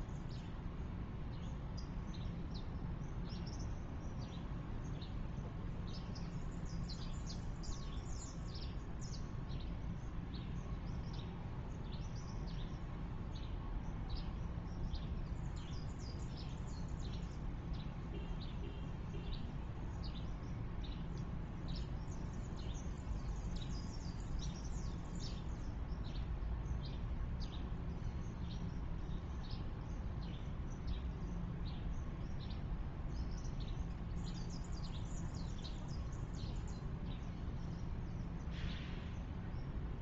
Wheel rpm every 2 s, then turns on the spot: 0, 0, 0, 0, 0, 0, 0, 0, 0, 0, 0, 0, 0, 0, 0, 0, 0, 0, 0, 0.
none